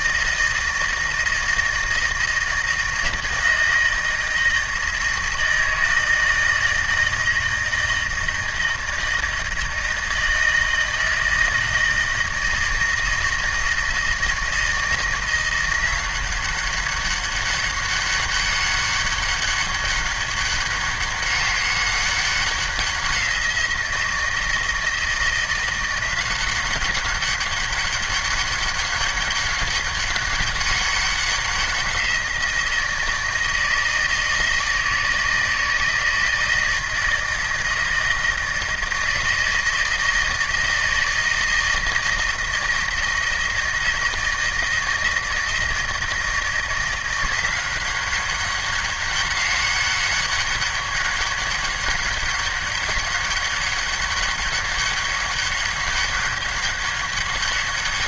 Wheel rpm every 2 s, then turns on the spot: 160, 160, 160, 160, 160, 160, 160, 160, 190, 200, 200, 190, 170, 190, 200, 200, 170, 160, 160, 160, 160, 160, 160, 170, 200, 200, 200, 200, 200.
none